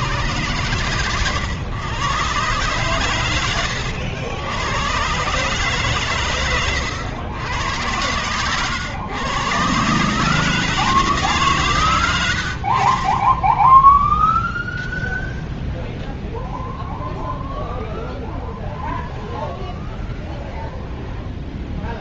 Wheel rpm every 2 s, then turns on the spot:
120, 120, 90, 130, 100, 140, 100, 0, 0, 0, 0.
none